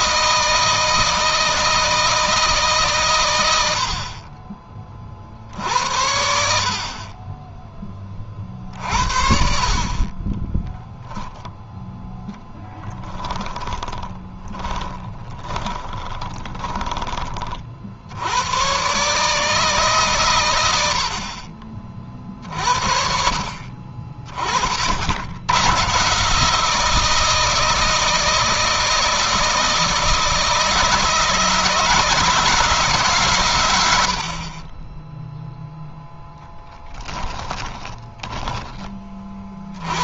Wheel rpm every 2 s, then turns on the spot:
160, 140, 40, 50, 60, 10, 10, 20, 20, 120, 90, 50, 50, 160, 160, 160, 150, 20, 10, 20.
12-16 36-38